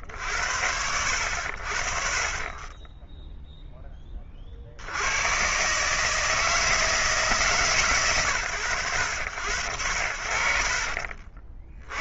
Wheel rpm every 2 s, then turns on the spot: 60, 10, 140, 140, 70, 70.
none